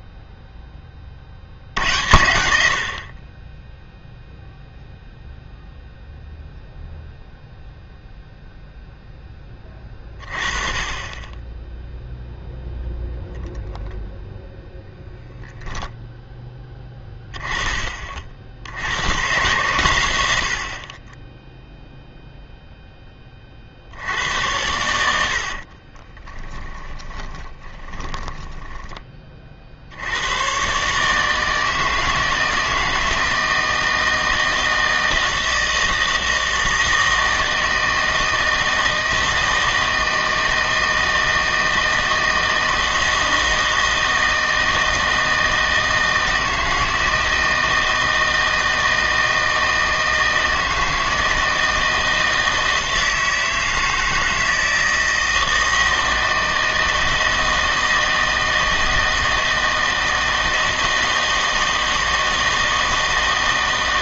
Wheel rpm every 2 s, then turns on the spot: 10, 80, 0, 0, 0, 30, 0, 0, 10, 80, 50, 0, 90, 20, 20, 130, 160, 160, 160, 160, 160, 160, 160, 160, 160, 160, 160, 160, 160, 160, 160, 160.
24-30